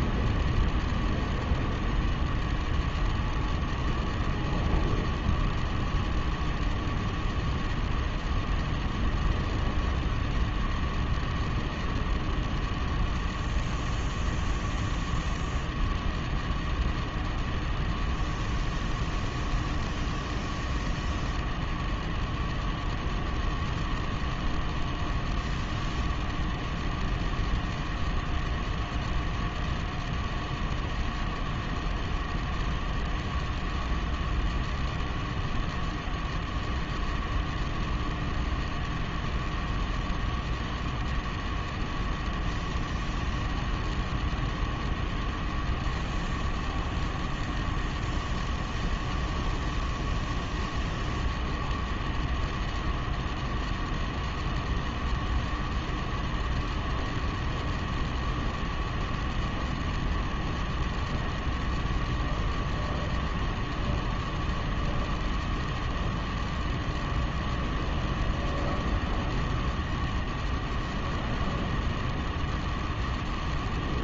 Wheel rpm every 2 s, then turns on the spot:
0, 0, 0, 0, 0, 0, 0, 0, 0, 0, 0, 0, 0, 0, 0, 0, 0, 0, 0, 0, 0, 0, 0, 0, 0, 0, 0, 0, 0, 0, 0, 0, 0, 0, 0, 0, 0.
none